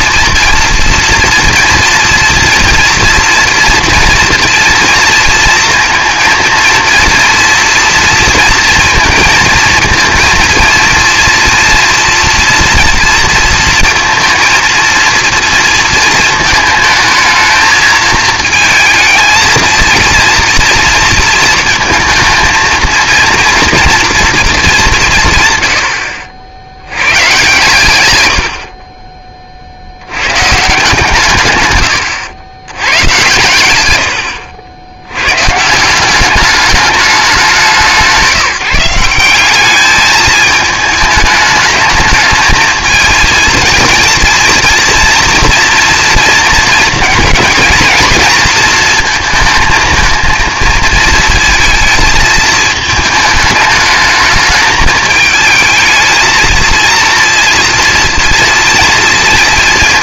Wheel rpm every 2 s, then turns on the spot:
230, 230, 230, 230, 230, 230, 230, 230, 220, 220, 230, 230, 200, 90, 40, 150, 100, 80, 210, 170, 210, 220, 230, 230, 230, 220, 220, 210, 230, 230.
none